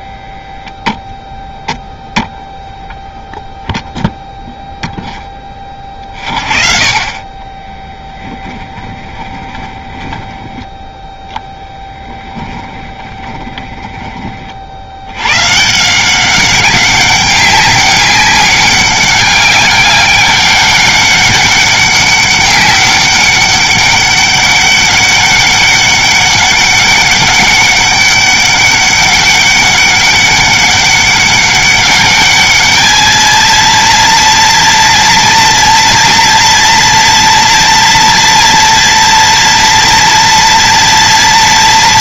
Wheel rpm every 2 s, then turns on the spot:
0, 0, 0, 30, 30, 10, 10, 70, 190, 200, 200, 190, 200, 200, 200, 200, 220, 230, 230, 230, 230.
8-10 12-14